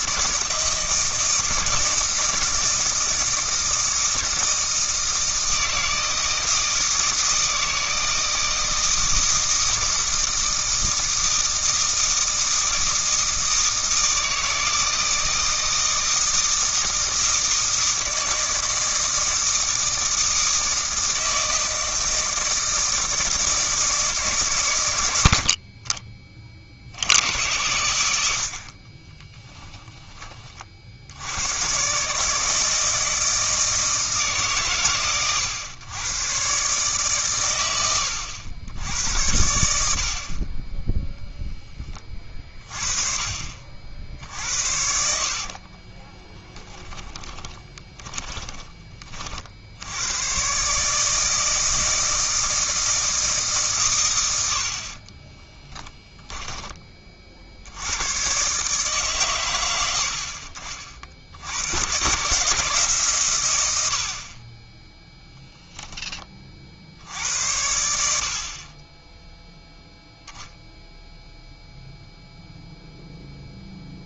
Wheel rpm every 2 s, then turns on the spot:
160, 160, 160, 160, 160, 160, 160, 160, 160, 160, 160, 160, 140, 40, 70, 40, 160, 140, 130, 90, 20, 30, 60, 10, 20, 130, 160, 70, 20, 140, 50, 140, 20, 40, 40, 0, 0.
44-50